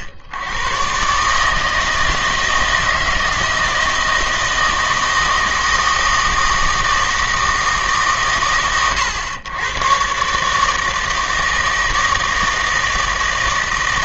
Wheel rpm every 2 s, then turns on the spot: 90, 160, 160, 160, 80, 150, 160.
none